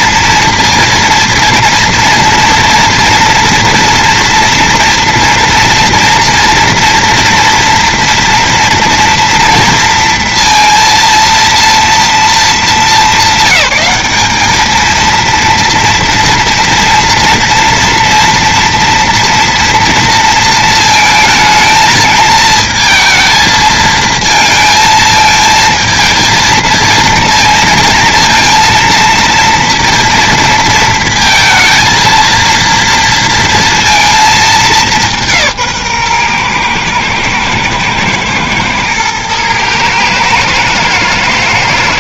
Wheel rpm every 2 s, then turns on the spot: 230, 230, 230, 230, 230, 230, 210, 210, 240, 230, 230, 220, 220, 230, 230, 230, 230, 210, 120, 110, 110.
none